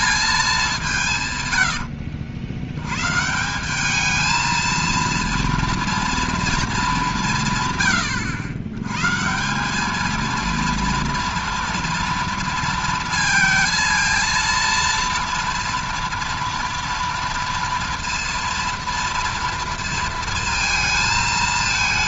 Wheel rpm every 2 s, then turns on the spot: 180, 90, 230, 220, 120, 230, 230, 230, 230, 230, 220.
none